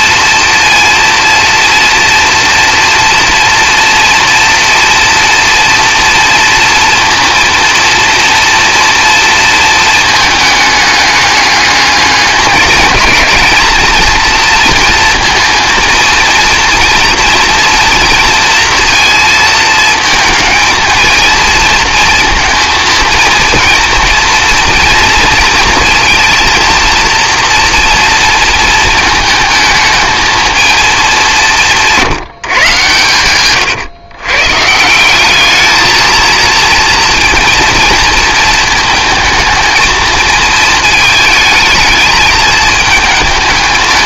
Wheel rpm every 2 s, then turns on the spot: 230, 230, 230, 230, 230, 210, 210, 230, 230, 230, 230, 230, 230, 230, 220, 220, 140, 160, 230, 230, 220, 210.
none